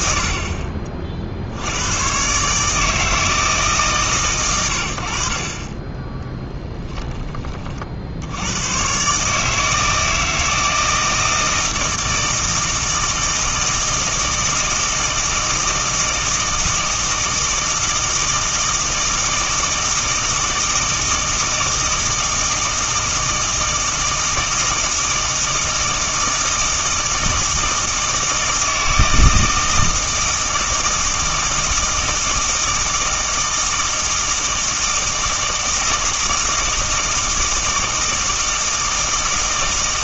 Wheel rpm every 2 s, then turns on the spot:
40, 150, 80, 10, 130, 160, 160, 160, 160, 160, 160, 160, 160, 160, 160, 160, 160, 160, 160, 160.
6-8